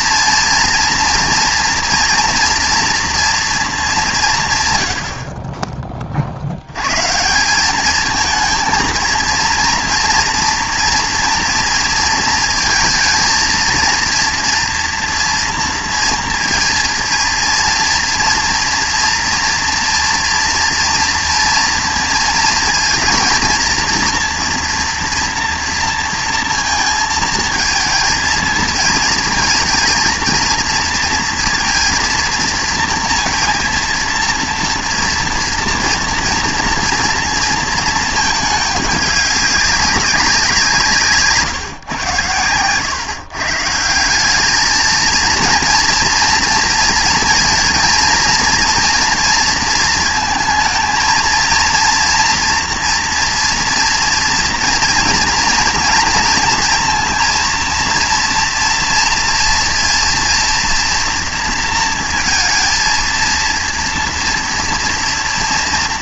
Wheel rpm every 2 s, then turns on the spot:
230, 230, 120, 100, 230, 240, 220, 230, 230, 230, 230, 220, 230, 230, 230, 230, 230, 230, 230, 210, 170, 110, 210, 230, 230, 230, 240, 240, 230, 230, 230, 230, 230.
none